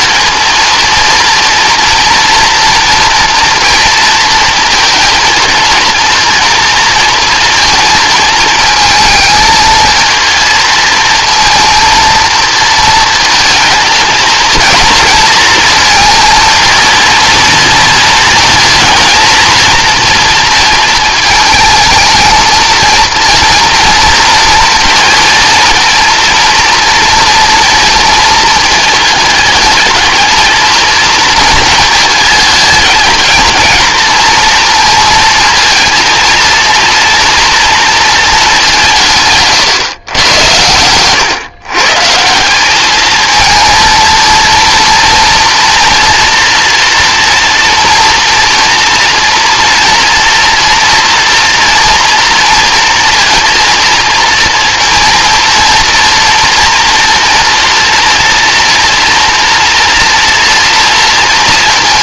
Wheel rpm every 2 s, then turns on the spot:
230, 240, 220, 230, 220, 220, 220, 230, 230, 220, 220, 230, 230, 230, 220, 230, 220, 230, 240, 170, 110, 220, 230, 230, 230, 230, 230, 230, 230, 230, 230.
none